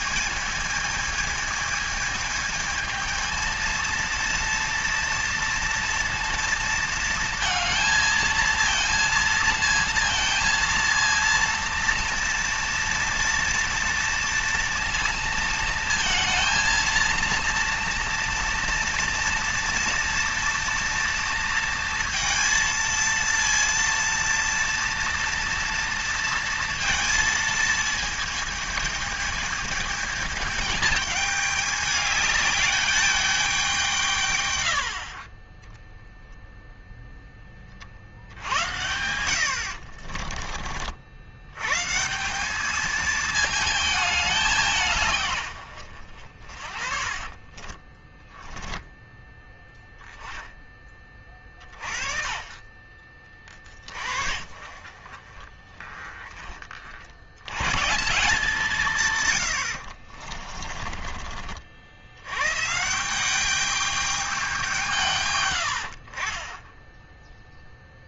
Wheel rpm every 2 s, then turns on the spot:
220, 220, 230, 230, 230, 230, 230, 230, 230, 230, 230, 230, 230, 230, 220, 210, 210, 70, 10, 80, 60, 210, 160, 40, 10, 20, 40, 40, 50, 160, 30, 170, 170, 10.
46-50 60-62